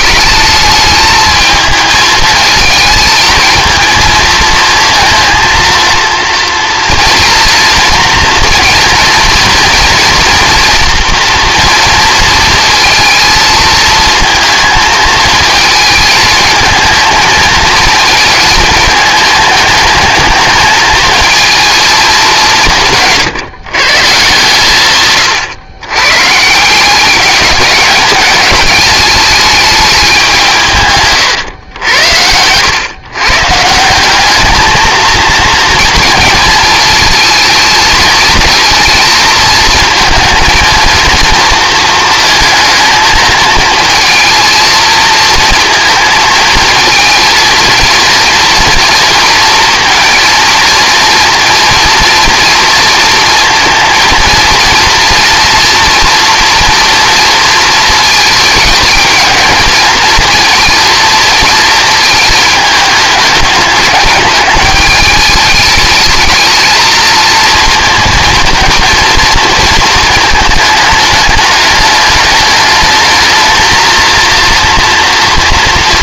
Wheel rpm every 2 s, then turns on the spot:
210, 220, 230, 230, 230, 230, 230, 220, 220, 220, 220, 180, 140, 170, 210, 170, 100, 220, 220, 230, 230, 220, 220, 230, 230, 230, 230, 230, 230, 220, 220, 210, 210, 220, 230, 220, 220, 230.
none